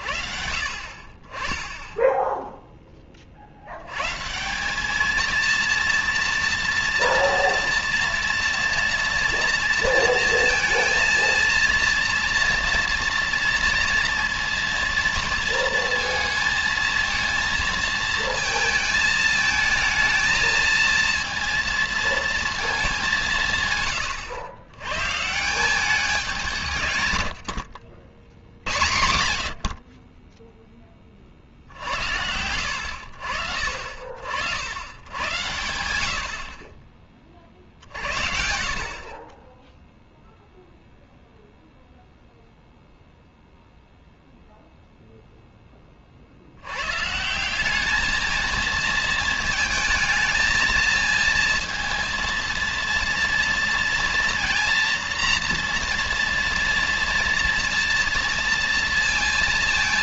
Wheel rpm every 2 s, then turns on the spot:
40, 10, 200, 230, 230, 230, 240, 230, 230, 220, 230, 210, 110, 140, 70, 10, 90, 80, 40, 60, 0, 0, 0, 80, 220, 220, 230, 230, 230, 230.
none